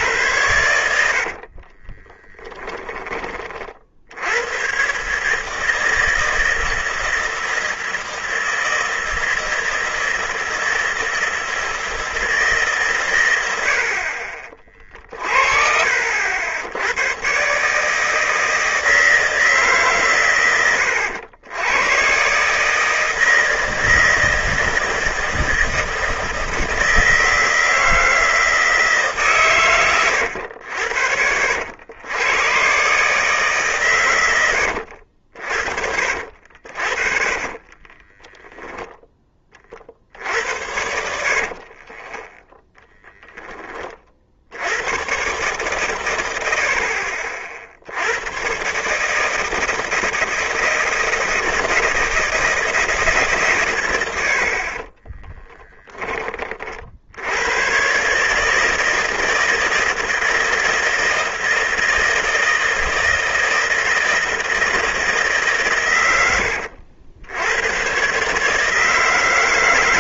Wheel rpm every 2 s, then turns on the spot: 80, 20, 140, 160, 160, 160, 130, 40, 100, 160, 90, 160, 160, 160, 150, 70, 140, 70, 40, 10, 60, 0, 110, 60, 150, 160, 150, 30, 60, 160, 160, 160, 160, 90, 160.
0-2 34-38 40-42 54-56